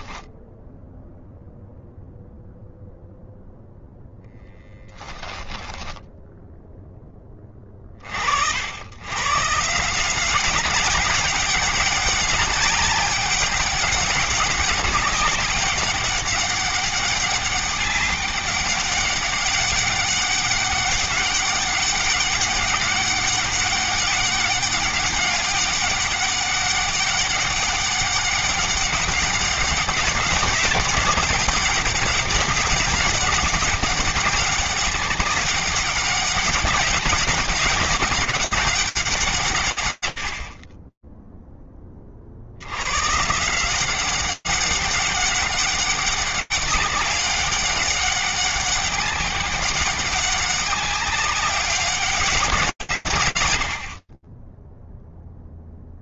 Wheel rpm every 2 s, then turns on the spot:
0, 0, 10, 20, 150, 200, 200, 200, 200, 190, 200, 200, 200, 200, 190, 190, 190, 200, 200, 130, 20, 180, 200, 200, 200, 200, 80, 0.
4-6